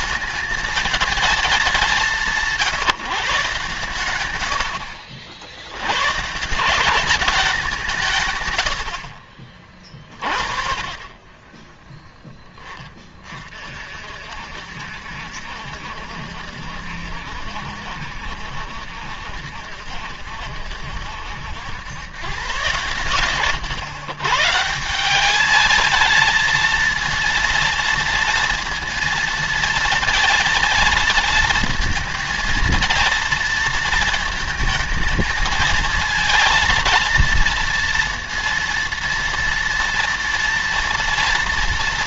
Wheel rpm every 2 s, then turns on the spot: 220, 160, 70, 200, 60, 30, 30, 70, 70, 70, 70, 120, 170, 230, 230, 230, 230, 220, 230, 230, 230.
none